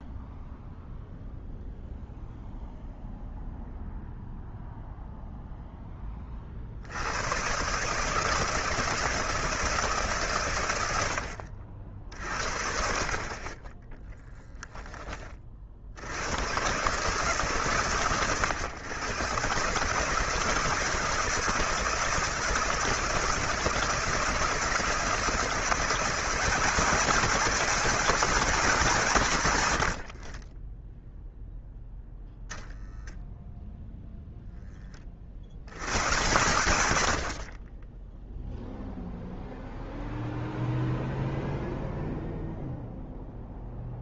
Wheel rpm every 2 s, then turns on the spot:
0, 0, 0, 70, 150, 90, 60, 10, 130, 110, 160, 160, 160, 190, 190, 10, 0, 20, 120, 0, 0, 0.
none